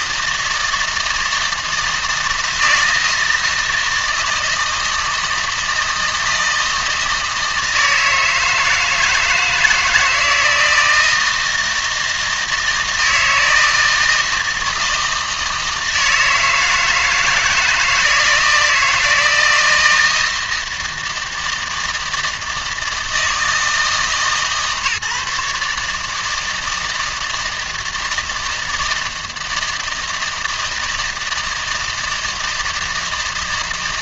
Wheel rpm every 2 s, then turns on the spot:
160, 160, 160, 160, 160, 160, 160, 160, 160, 160, 160, 160, 150, 160, 160, 160, 160.
none